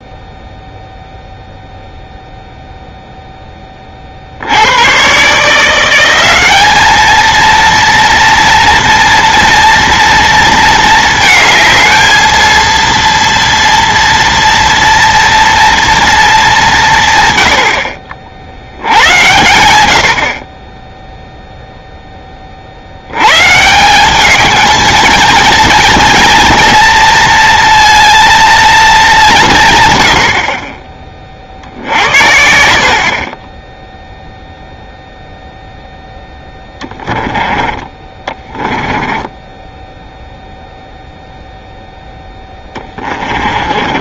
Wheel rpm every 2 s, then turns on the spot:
0, 0, 90, 210, 230, 230, 230, 230, 200, 80, 30, 40, 220, 230, 230, 40, 60, 0, 10, 20, 0, 10.
36-40 42-44